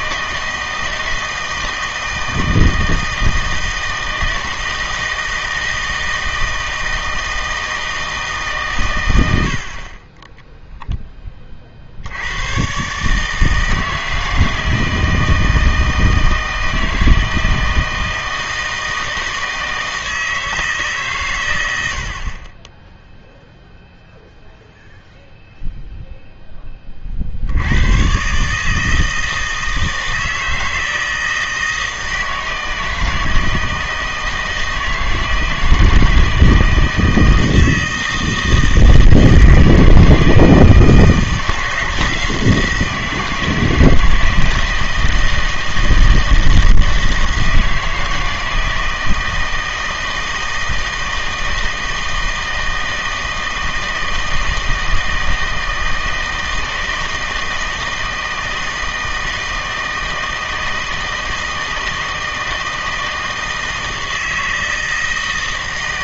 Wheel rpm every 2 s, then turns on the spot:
160, 160, 160, 160, 120, 0, 130, 160, 160, 160, 150, 10, 0, 20, 150, 160, 160, 160, 160, 160, 160, 170, 160, 160, 160, 160, 160, 160, 160, 160, 160, 160, 160.
none